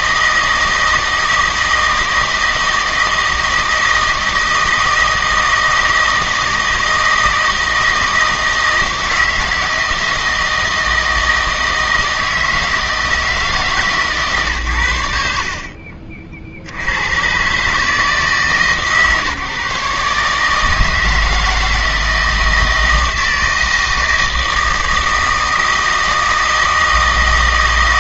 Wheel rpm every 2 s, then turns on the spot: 160, 160, 160, 160, 160, 160, 160, 120, 80, 150, 150, 160, 160, 160.
none